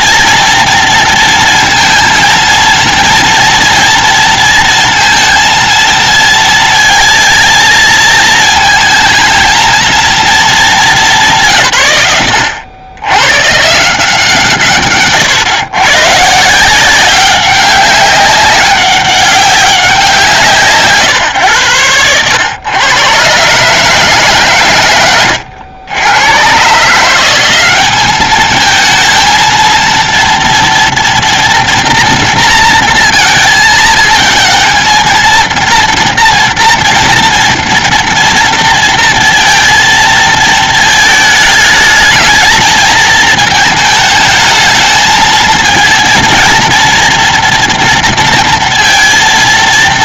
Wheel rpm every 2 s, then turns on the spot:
230, 230, 230, 230, 220, 180, 100, 130, 190, 190, 140, 110, 100, 160, 220, 230, 230, 230, 230, 230, 220, 220, 220, 230, 230.
none